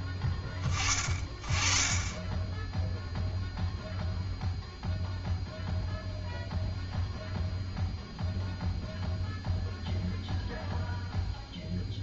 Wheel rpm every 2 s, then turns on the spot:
20, 10, 0, 0, 0, 0.
none